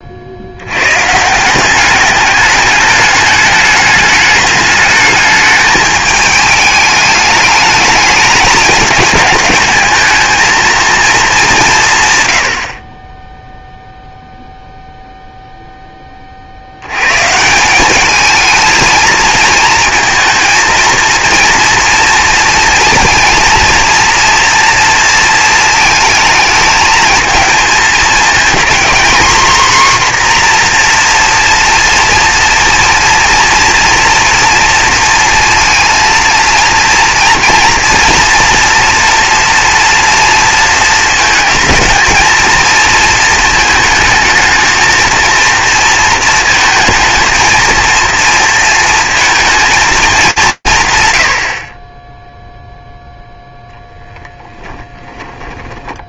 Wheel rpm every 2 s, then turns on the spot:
110, 210, 210, 210, 210, 230, 40, 0, 70, 220, 230, 230, 230, 220, 230, 250, 230, 230, 230, 230, 230, 230, 230, 220, 230, 180, 10, 30.
54-56